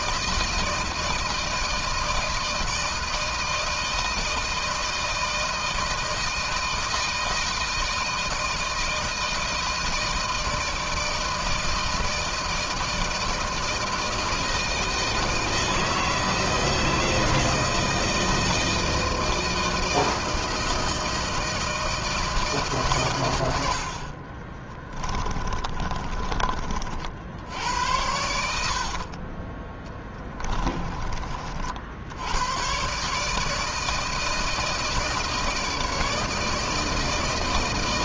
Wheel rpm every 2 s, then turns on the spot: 160, 160, 160, 160, 160, 160, 160, 160, 160, 160, 160, 160, 50, 30, 90, 20, 100, 160, 160.
24-26 28-32